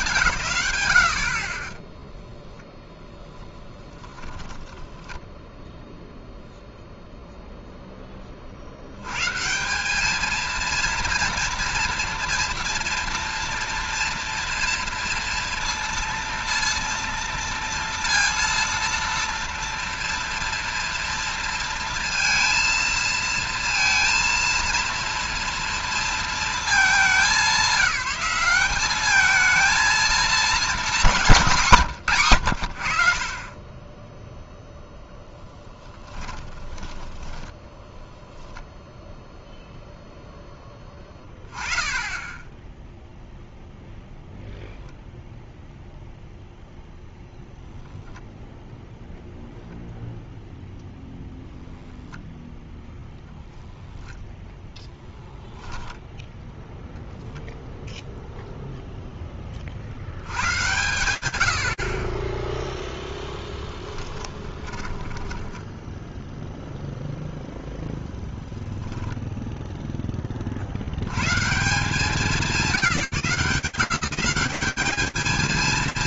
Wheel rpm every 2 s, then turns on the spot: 120, 0, 10, 0, 70, 230, 230, 230, 230, 230, 230, 230, 230, 220, 190, 210, 90, 0, 10, 0, 10, 10, 0, 0, 0, 0, 0, 0, 0, 0, 100, 0, 20, 0, 0, 50, 190, 220.
4-6 36-38 64-66